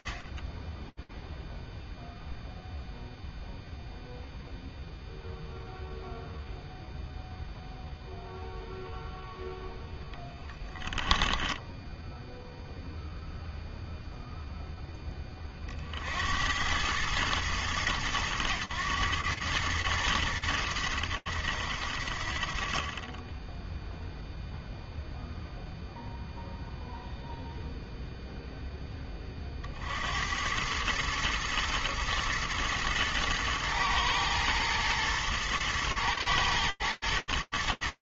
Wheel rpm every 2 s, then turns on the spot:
10, 0, 0, 0, 0, 10, 0, 50, 110, 100, 40, 0, 0, 0, 60, 110, 110, 110, 110.
10-12